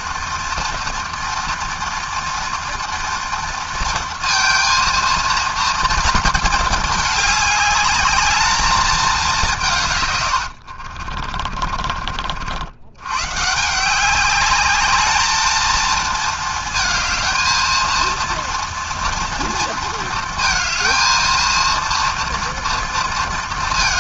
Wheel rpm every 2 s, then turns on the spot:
230, 230, 230, 220, 210, 90, 80, 210, 230, 230, 230, 230.
10-12